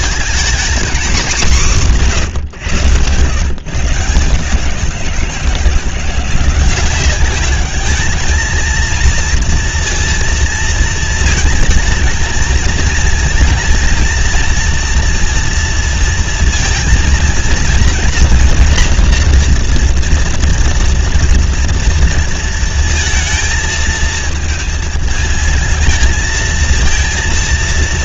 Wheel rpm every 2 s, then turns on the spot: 220, 170, 160, 170, 220, 230, 220, 230, 230, 230, 230, 230, 230, 220.
none